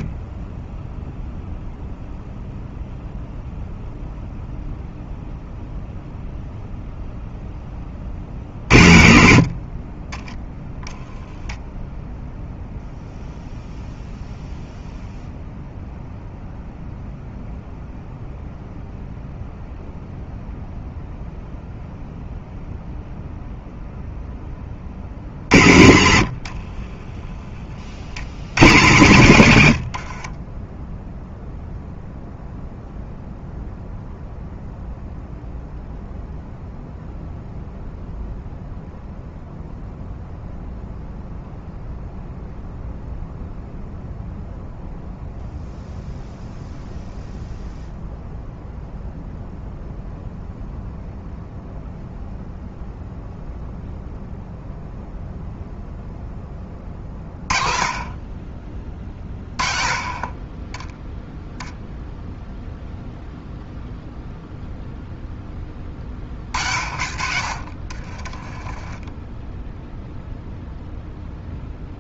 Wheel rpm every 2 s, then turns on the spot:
10, 0, 0, 0, 70, 0, 0, 0, 0, 0, 0, 0, 40, 20, 110, 10, 0, 0, 0, 0, 0, 0, 0, 0, 0, 0, 0, 0, 30, 40, 10, 0, 0, 50, 10, 0.
26-28 66-70